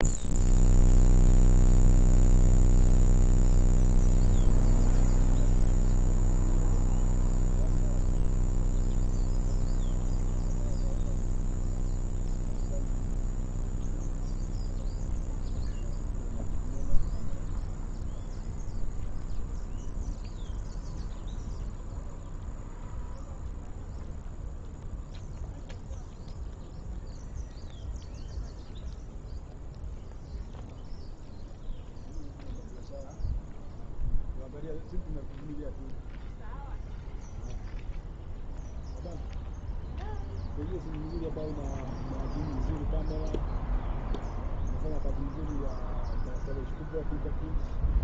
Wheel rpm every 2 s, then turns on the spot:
0, 0, 0, 0, 0, 0, 0, 0, 0, 0, 0, 0, 0, 0, 0, 0, 0, 0, 0, 0, 0, 0, 0, 0.
none